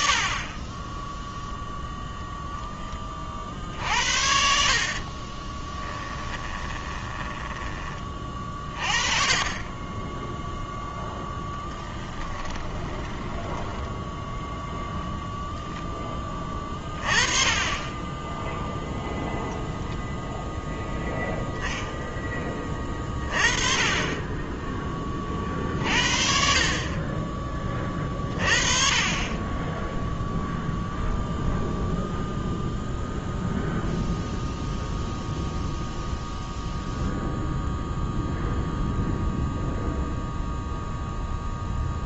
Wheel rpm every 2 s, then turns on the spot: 30, 10, 50, 10, 40, 0, 10, 0, 20, 10, 0, 20, 20, 50, 30, 0, 0, 0, 0, 0, 0.
6-8 12-14